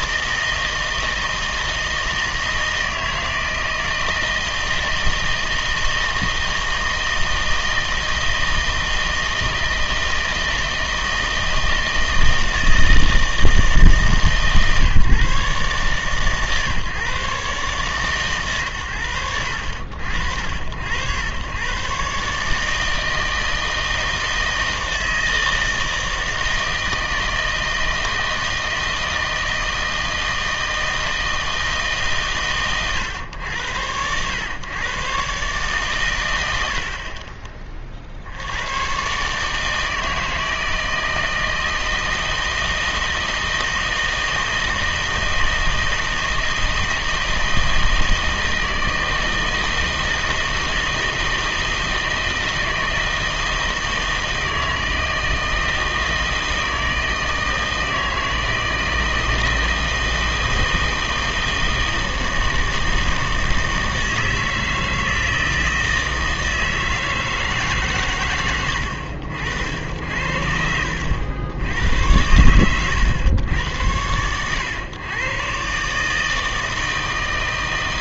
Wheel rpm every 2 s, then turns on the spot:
160, 160, 160, 160, 160, 160, 160, 140, 150, 120, 80, 150, 160, 160, 160, 160, 130, 110, 80, 100, 160, 160, 160, 160, 160, 160, 160, 160, 160, 160, 160, 160, 160, 160, 100, 70, 110, 120, 160.
none